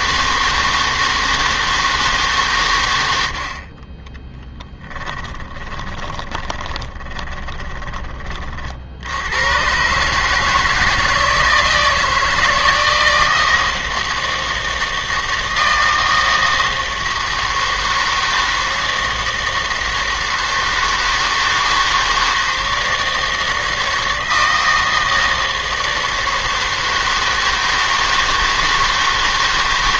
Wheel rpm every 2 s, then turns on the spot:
160, 130, 10, 20, 50, 160, 160, 160, 160, 160, 160, 160, 160, 160, 160.
4-8